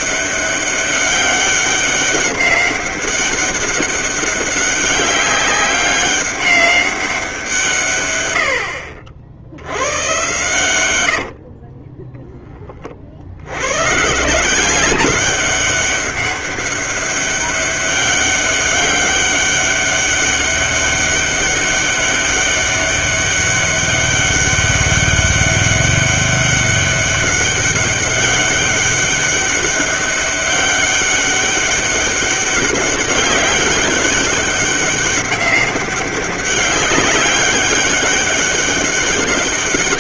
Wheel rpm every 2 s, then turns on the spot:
200, 200, 200, 200, 80, 110, 30, 190, 200, 200, 200, 200, 200, 200, 200, 200, 200, 200, 200, 200.
10-12